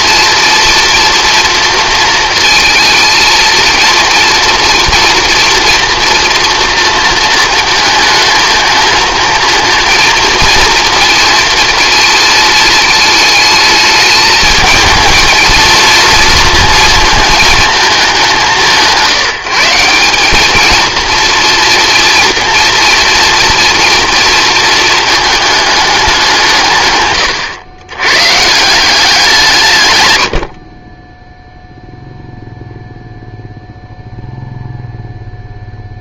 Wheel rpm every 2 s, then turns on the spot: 230, 230, 230, 230, 220, 220, 220, 220, 230, 180, 220, 230, 230, 150, 170, 40, 0, 0.
none